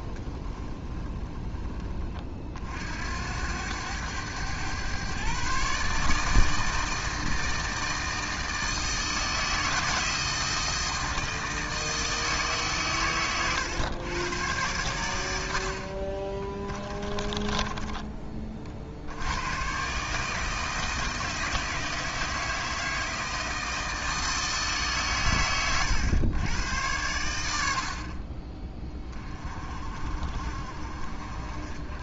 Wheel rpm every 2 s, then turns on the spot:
20, 70, 120, 160, 160, 160, 120, 100, 20, 70, 160, 160, 140, 100, 20, 40.
0-2 16-18